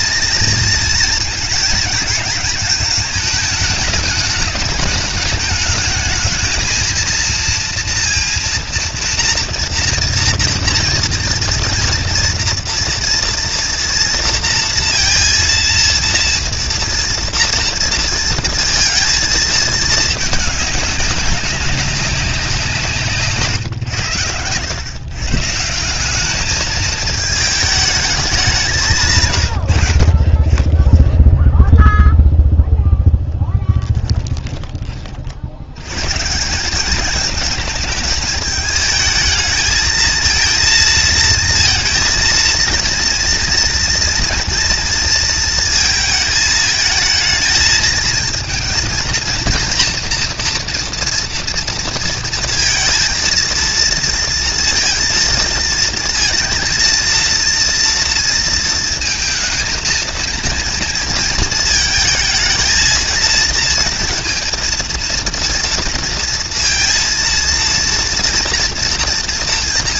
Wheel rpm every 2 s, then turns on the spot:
230, 220, 210, 220, 230, 230, 230, 230, 230, 230, 210, 170, 100, 210, 190, 20, 0, 20, 180, 220, 230, 230, 230, 220, 230, 230, 230, 230, 230, 230, 230, 220, 230, 230, 230.
34-36